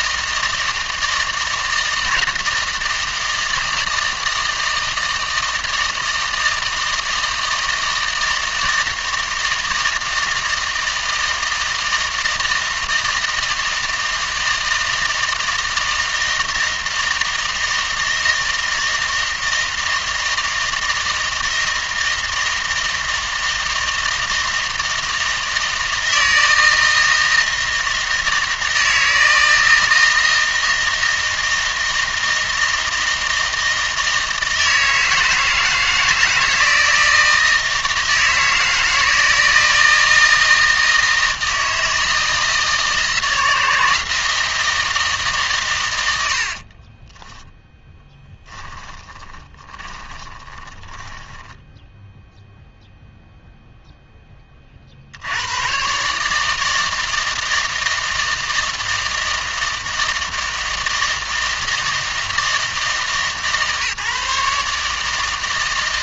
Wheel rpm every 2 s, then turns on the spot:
160, 160, 160, 160, 160, 160, 160, 160, 160, 160, 160, 160, 160, 160, 160, 160, 160, 160, 160, 160, 160, 160, 160, 50, 10, 20, 0, 30, 150, 160, 160, 160, 150.
46-52